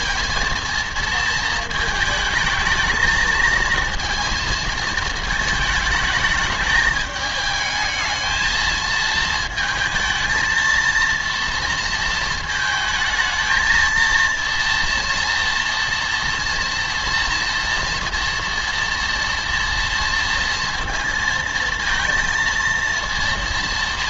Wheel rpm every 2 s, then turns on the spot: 230, 220, 230, 210, 220, 230, 220, 230, 230, 230, 230, 230.
none